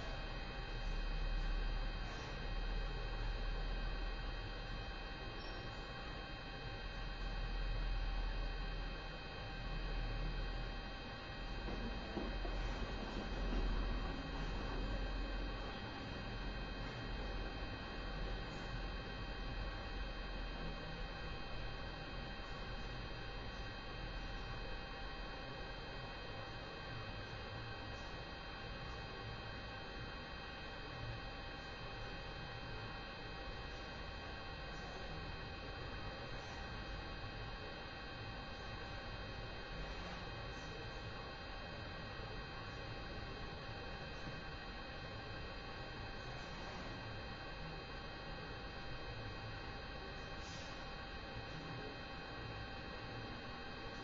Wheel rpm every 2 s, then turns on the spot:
0, 0, 0, 0, 0, 0, 0, 0, 0, 0, 0, 0, 0, 0, 0, 0, 0, 0, 0, 0, 0, 0, 0, 0, 0, 0, 0.
none